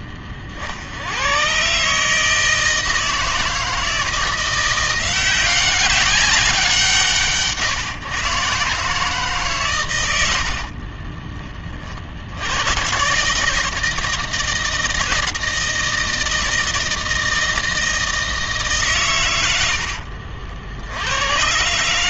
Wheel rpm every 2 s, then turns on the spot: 60, 160, 170, 180, 140, 60, 110, 160, 160, 150, 70.
10-12